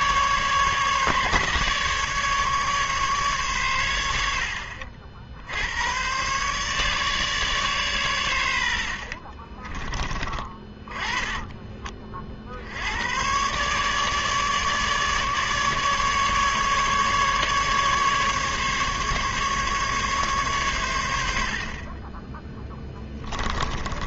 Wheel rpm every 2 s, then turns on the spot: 150, 150, 70, 140, 80, 30, 70, 150, 150, 150, 120, 10.
22-24